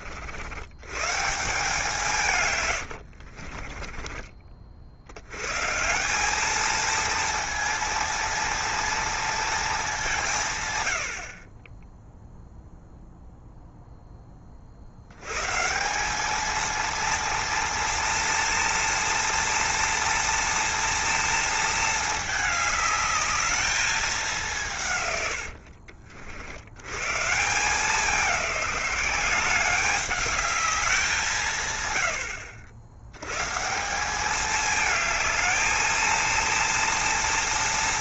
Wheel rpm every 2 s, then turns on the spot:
110, 120, 70, 220, 230, 110, 0, 60, 220, 240, 230, 210, 140, 100, 190, 190, 80, 220, 230.
2-4